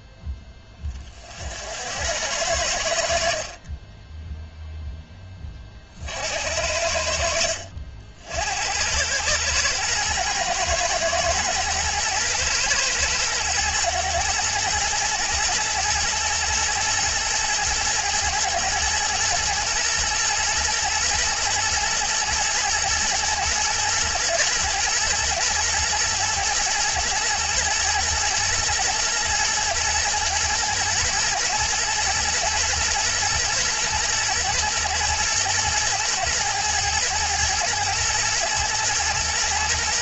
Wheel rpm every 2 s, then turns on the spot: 30, 70, 0, 70, 80, 110, 110, 110, 110, 120, 120, 120, 120, 120, 120, 110, 120, 120, 110, 120.
none